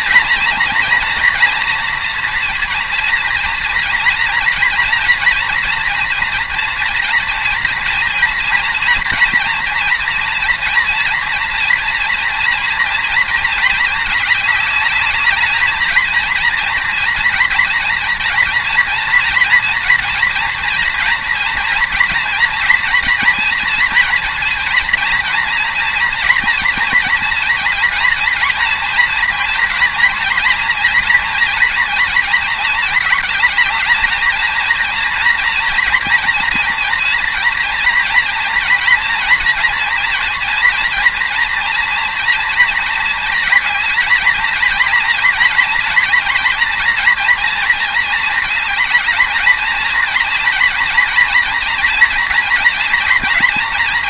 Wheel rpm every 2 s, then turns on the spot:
230, 230, 230, 230, 230, 230, 230, 210, 230, 230, 230, 230, 230, 230, 230, 230, 220, 230, 230, 230, 230, 230, 230, 230, 220, 230, 230.
none